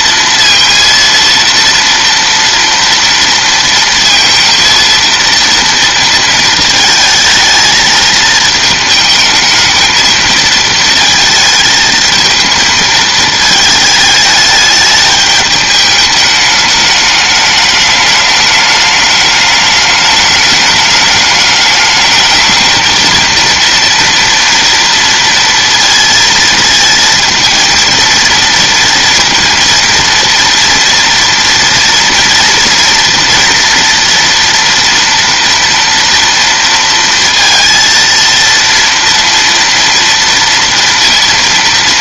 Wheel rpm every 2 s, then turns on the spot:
230, 230, 230, 220, 220, 220, 220, 210, 210, 210, 210, 220, 230, 220, 230, 230, 230, 240, 230, 230, 230.
none